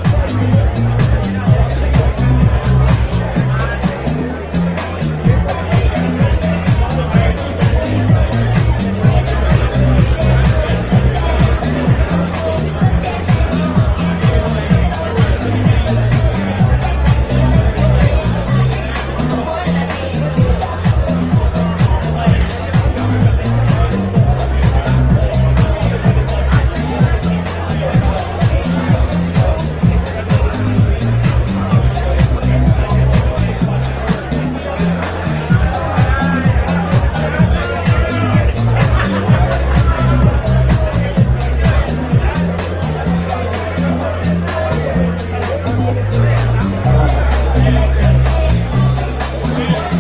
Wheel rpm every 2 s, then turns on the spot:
0, 0, 0, 0, 0, 0, 0, 0, 0, 0, 0, 0, 0, 0, 0, 0, 0, 0, 0, 0, 0, 0, 0, 0, 0.
none